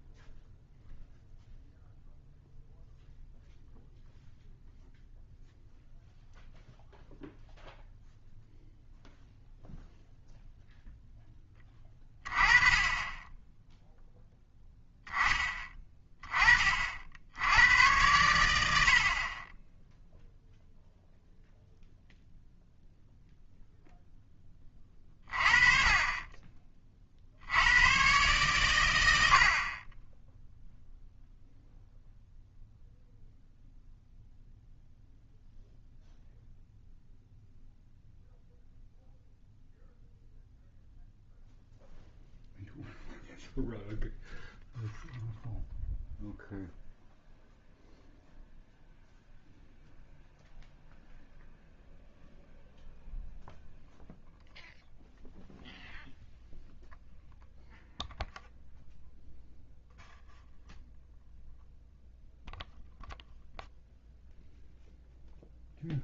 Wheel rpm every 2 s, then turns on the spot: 0, 0, 0, 0, 0, 0, 20, 10, 40, 80, 0, 0, 20, 30, 110, 0, 0, 0, 0, 0, 0, 0, 0, 0, 0, 0, 0, 0, 0, 0, 0, 0, 0.
none